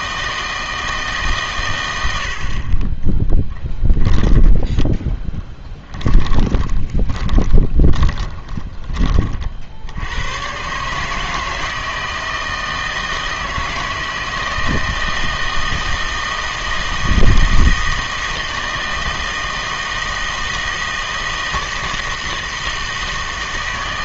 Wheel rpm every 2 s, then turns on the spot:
160, 40, 10, 20, 20, 130, 160, 160, 160, 160, 160, 160.
4-10